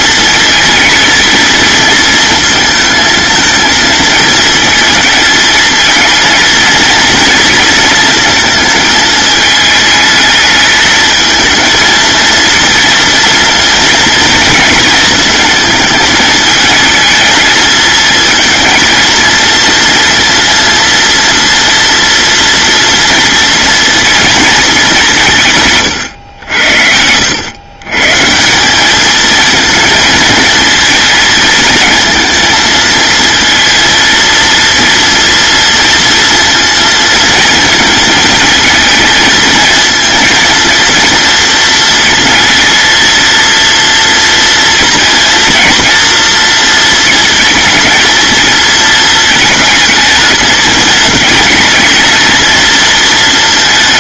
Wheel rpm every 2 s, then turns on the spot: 220, 220, 220, 230, 220, 220, 230, 230, 220, 230, 230, 230, 180, 80, 210, 230, 220, 230, 230, 220, 230, 230, 230, 230, 220, 210, 230.
none